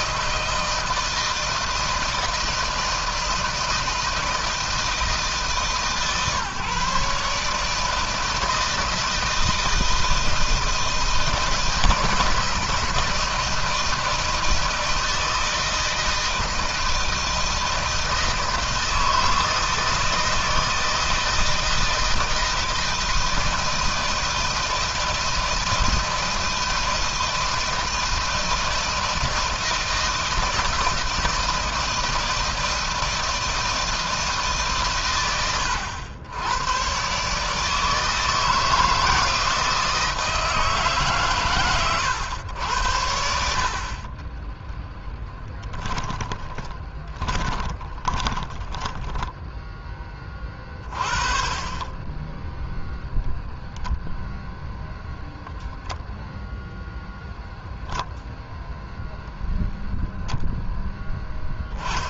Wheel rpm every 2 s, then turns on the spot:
160, 160, 160, 150, 160, 160, 160, 160, 160, 160, 160, 160, 160, 160, 160, 160, 160, 120, 130, 160, 150, 90, 10, 20, 10, 30, 0, 0, 10, 0, 0.
44-50